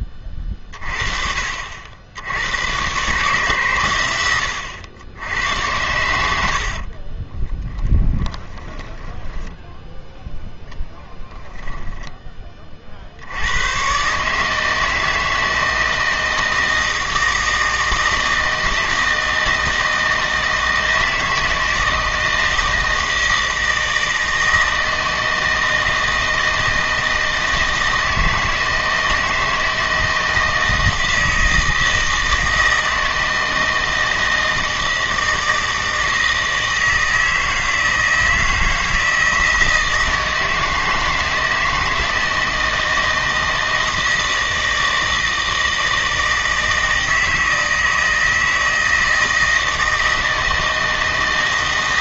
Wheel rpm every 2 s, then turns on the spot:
40, 110, 90, 50, 20, 10, 30, 160, 160, 160, 160, 160, 160, 160, 160, 160, 160, 160, 160, 160, 160, 160, 160, 160, 160, 160.
6-12